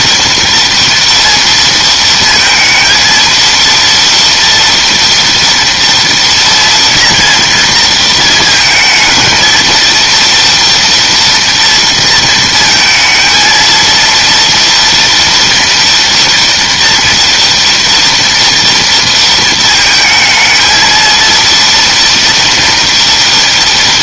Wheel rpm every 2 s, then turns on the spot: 230, 230, 240, 230, 230, 230, 230, 230, 230, 230, 230, 230.
none